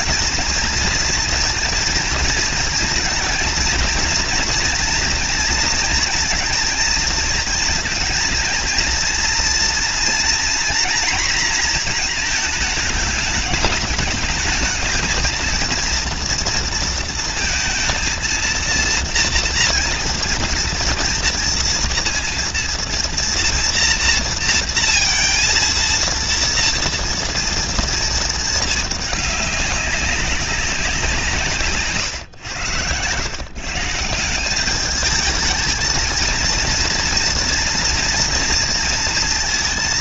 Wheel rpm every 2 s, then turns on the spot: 220, 230, 230, 230, 230, 240, 220, 220, 230, 230, 230, 230, 230, 230, 220, 190, 110, 200, 230, 230.
none